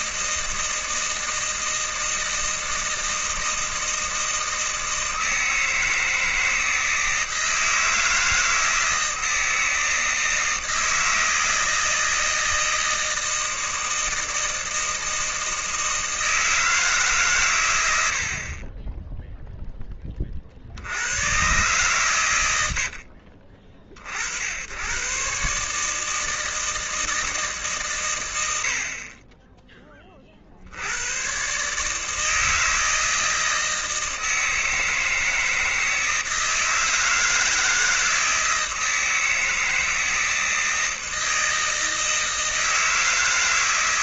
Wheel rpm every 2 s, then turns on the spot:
160, 160, 160, 160, 160, 160, 160, 160, 160, 30, 60, 80, 100, 160, 60, 80, 160, 160, 160, 160, 160, 160.
22-24